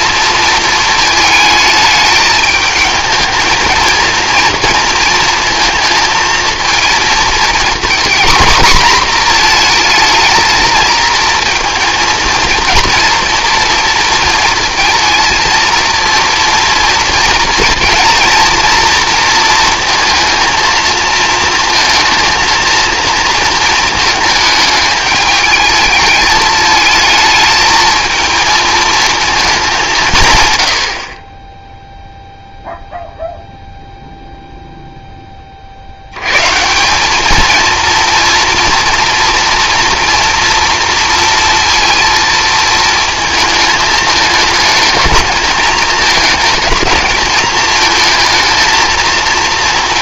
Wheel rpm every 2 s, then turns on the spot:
220, 220, 230, 230, 240, 220, 240, 230, 230, 230, 230, 230, 210, 220, 220, 60, 0, 0, 150, 240, 230, 220, 210, 220, 220.
none